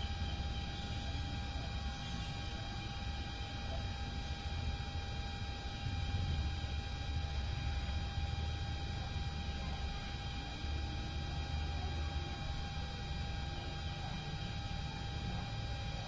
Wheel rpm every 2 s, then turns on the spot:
0, 0, 0, 0, 0, 0, 0, 0.
none